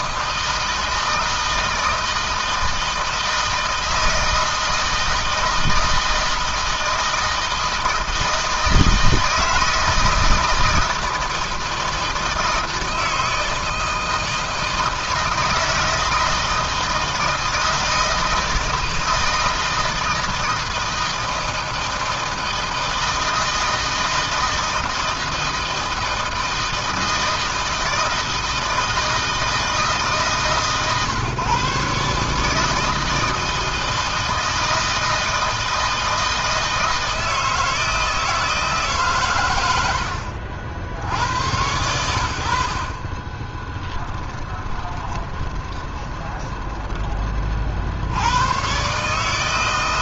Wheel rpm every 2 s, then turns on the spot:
160, 160, 160, 170, 160, 160, 160, 160, 160, 160, 160, 160, 160, 160, 160, 140, 160, 160, 160, 140, 70, 30, 20, 20, 140.
44-46